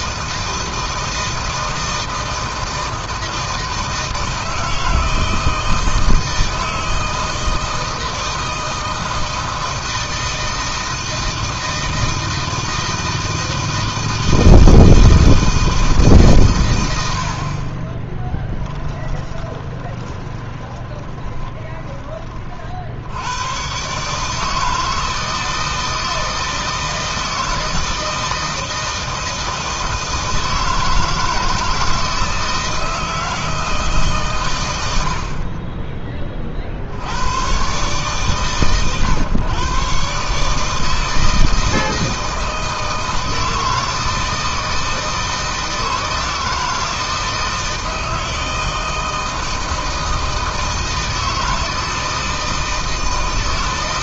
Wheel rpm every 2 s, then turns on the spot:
160, 160, 160, 160, 160, 160, 160, 160, 60, 20, 20, 80, 160, 160, 160, 160, 160, 50, 100, 130, 160, 160, 160, 160, 160, 160, 160.
18-22